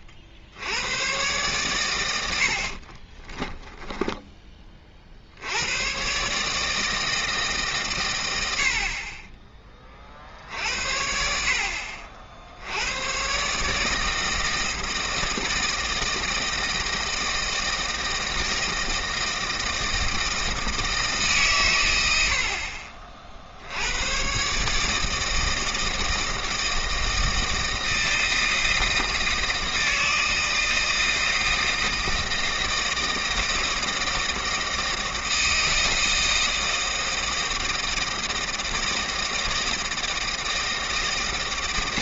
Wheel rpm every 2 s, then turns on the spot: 60, 60, 30, 150, 70, 60, 100, 160, 160, 160, 160, 50, 150, 160, 160, 160, 160, 170, 160, 160, 160.
2-4